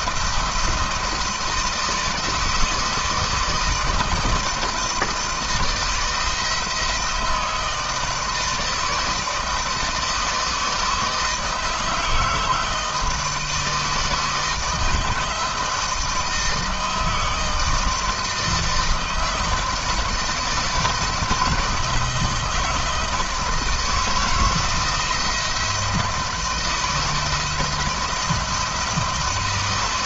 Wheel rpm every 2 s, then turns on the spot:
170, 160, 160, 160, 160, 160, 160, 160, 160, 160, 160, 160, 170, 160, 160.
none